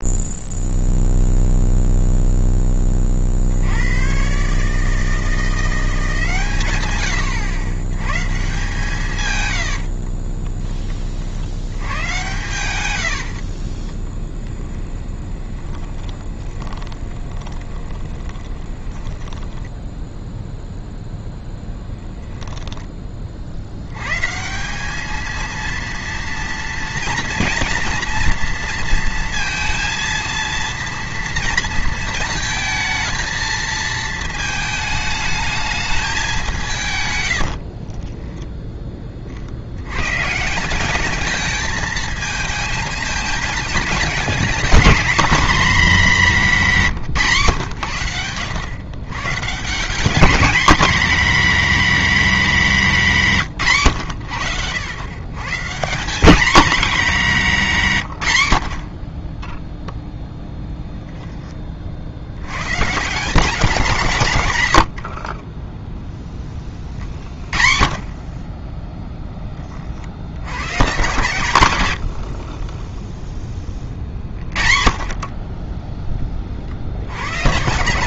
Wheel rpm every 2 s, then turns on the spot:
0, 10, 150, 120, 150, 30, 90, 10, 20, 10, 0, 10, 180, 230, 230, 230, 220, 220, 160, 10, 180, 220, 230, 190, 110, 230, 190, 90, 220, 50, 0, 120, 100, 30, 20, 120, 30, 40, 50.
14-20 46-48 72-74